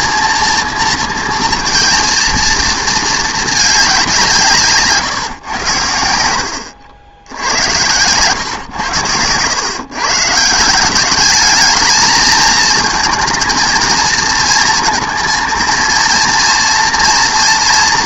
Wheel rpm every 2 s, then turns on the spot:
230, 230, 150, 80, 130, 170, 220, 230, 230.
none